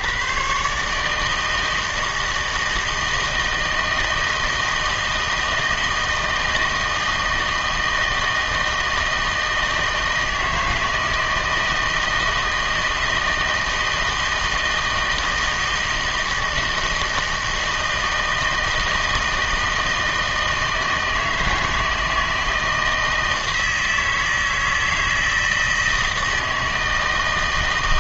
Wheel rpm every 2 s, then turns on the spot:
130, 160, 160, 160, 160, 160, 160, 160, 160, 160, 160, 160, 160, 160.
none